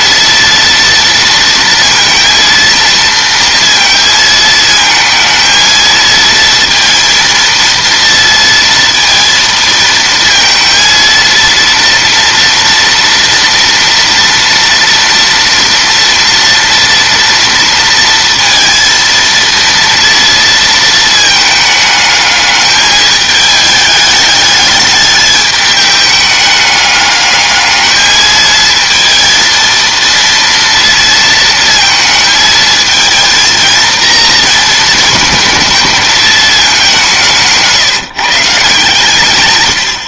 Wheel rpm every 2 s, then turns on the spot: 230, 230, 220, 230, 230, 230, 230, 230, 230, 230, 230, 210, 210, 210, 220, 230, 220, 220, 210, 150.
none